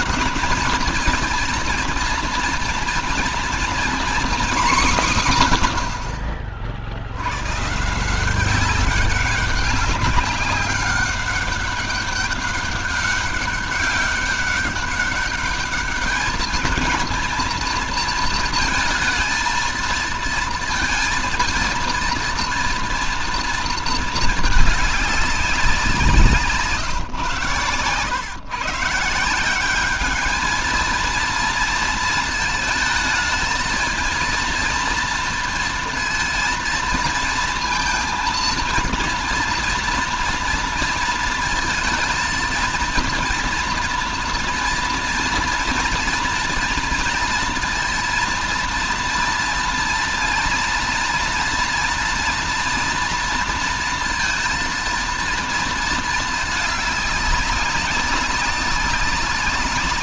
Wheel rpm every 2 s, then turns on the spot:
220, 230, 200, 60, 190, 200, 200, 200, 220, 230, 230, 230, 210, 150, 150, 230, 220, 230, 230, 230, 230, 230, 230, 230, 240, 230, 230, 230, 210, 200.
none